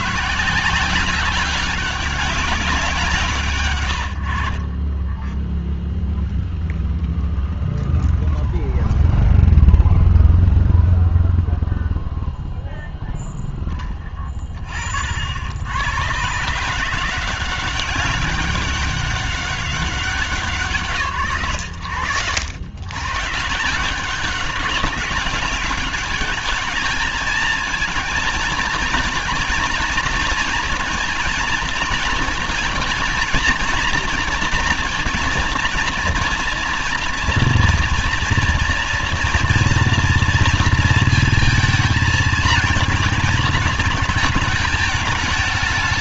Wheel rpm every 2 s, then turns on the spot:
150, 190, 60, 0, 0, 0, 0, 30, 140, 200, 160, 110, 200, 210, 220, 230, 230, 230, 230, 230, 230, 230, 220.
4-6